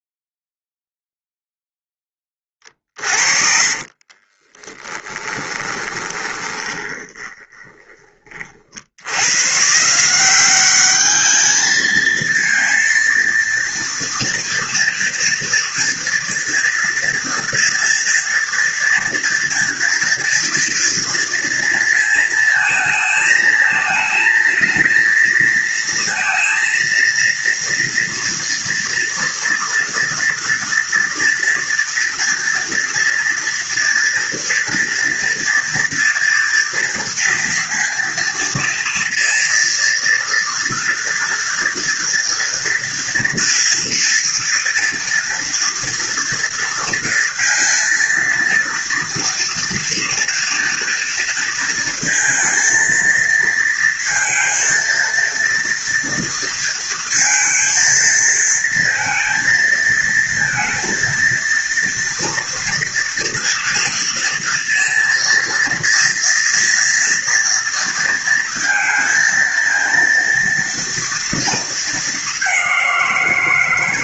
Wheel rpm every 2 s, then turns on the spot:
0, 30, 20, 20, 80, 210, 230, 230, 230, 230, 230, 220, 230, 230, 230, 230, 230, 240, 230, 230, 230, 230, 240, 230, 230, 230, 230, 230, 230, 230, 230, 230, 230, 230, 230, 230, 180.
2-8